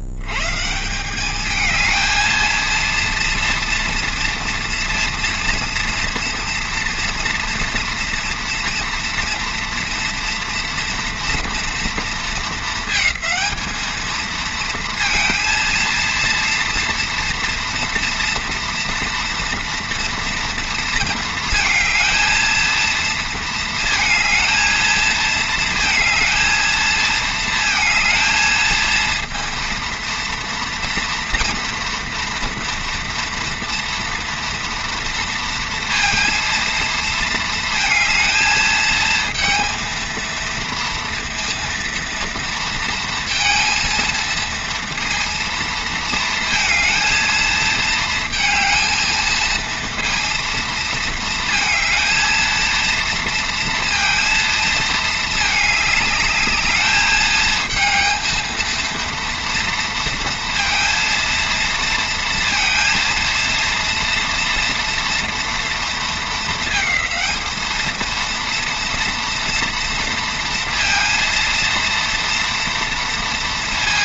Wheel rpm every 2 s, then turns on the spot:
110, 230, 240, 230, 230, 230, 230, 220, 230, 230, 230, 230, 220, 220, 220, 230, 230, 230, 230, 220, 230, 230, 230, 230, 220, 230, 220, 230, 210, 230, 230, 230, 230, 220, 230, 230, 230.
none